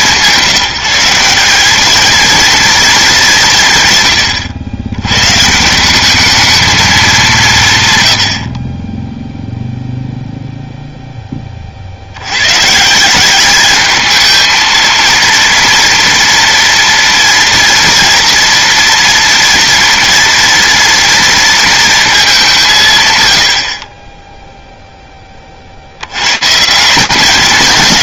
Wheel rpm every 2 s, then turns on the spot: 180, 190, 130, 180, 0, 20, 190, 230, 230, 230, 230, 100, 50, 210.
none